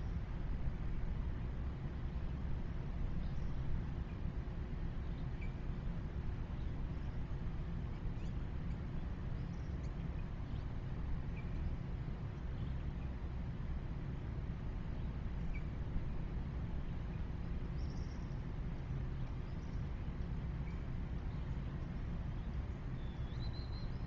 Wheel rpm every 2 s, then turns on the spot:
0, 0, 0, 0, 0, 0, 0, 0, 0, 0, 0, 0.
none